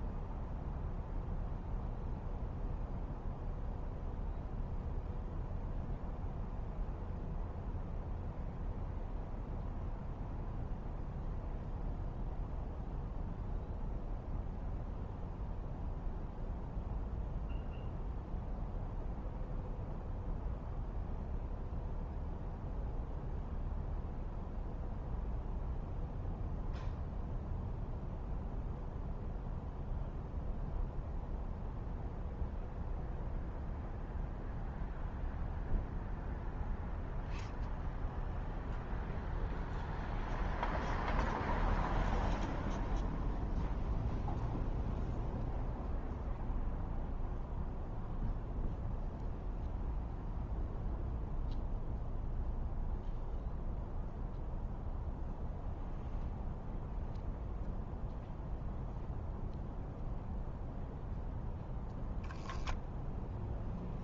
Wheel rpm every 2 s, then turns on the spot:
0, 0, 0, 0, 0, 0, 0, 0, 0, 0, 0, 0, 0, 0, 0, 0, 0, 0, 0, 0, 0, 0, 0, 0, 0, 0, 0, 0, 0, 0, 0, 0.
none